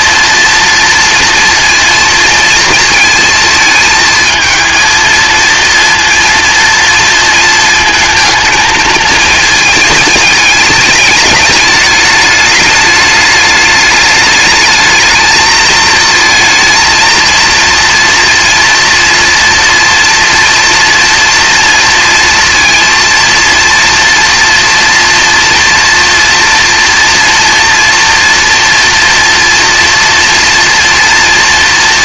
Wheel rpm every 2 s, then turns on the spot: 230, 230, 220, 230, 220, 210, 210, 210, 230, 230, 230, 230, 240, 230, 230, 230.
none